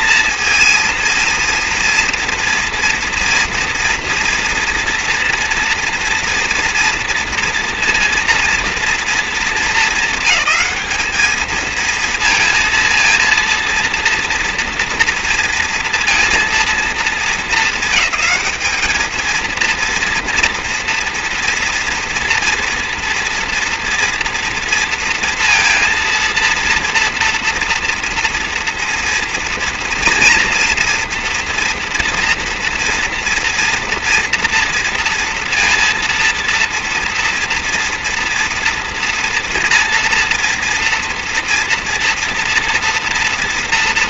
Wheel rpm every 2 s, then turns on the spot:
230, 230, 230, 230, 230, 200, 230, 230, 230, 220, 230, 230, 230, 230, 230, 230, 230, 230, 230, 230, 230, 230.
none